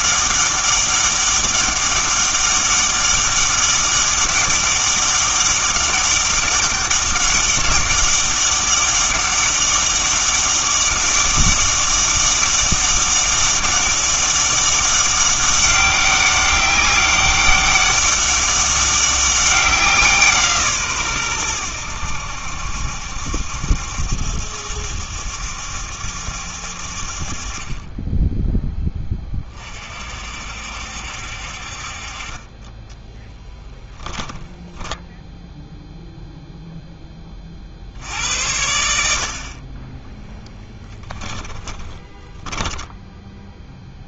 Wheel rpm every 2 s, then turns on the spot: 200, 200, 200, 200, 200, 200, 200, 200, 200, 200, 150, 70, 70, 60, 10, 60, 20, 10, 0, 80, 10, 10.
34-36 40-44